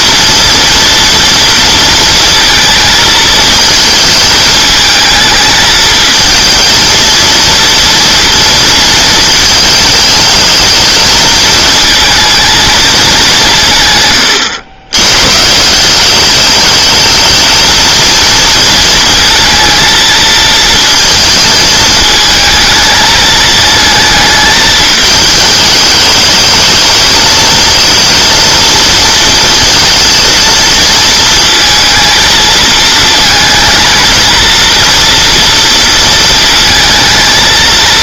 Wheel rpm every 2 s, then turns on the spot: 230, 220, 220, 230, 230, 220, 220, 100, 220, 230, 220, 220, 220, 220, 230, 230, 220, 230, 230.
none